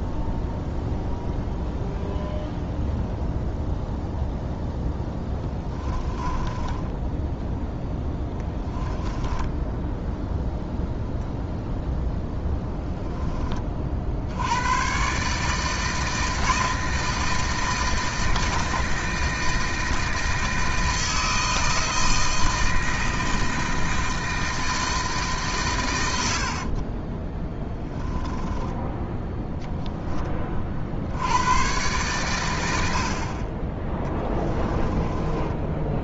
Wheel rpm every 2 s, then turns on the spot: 0, 0, 0, 10, 10, 0, 10, 120, 160, 160, 160, 160, 160, 40, 10, 60, 80, 20.
6-10 26-28 34-36